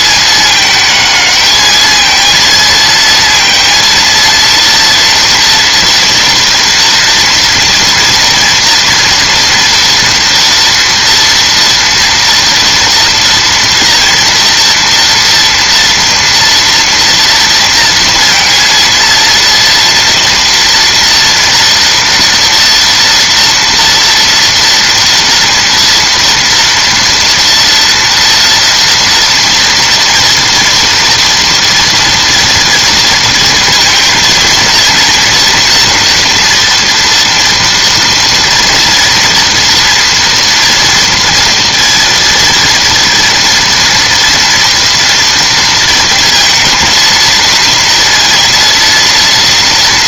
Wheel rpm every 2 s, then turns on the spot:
210, 230, 230, 230, 230, 230, 230, 240, 230, 230, 230, 230, 230, 230, 240, 230, 230, 230, 230, 230, 240, 230, 240, 230, 230.
none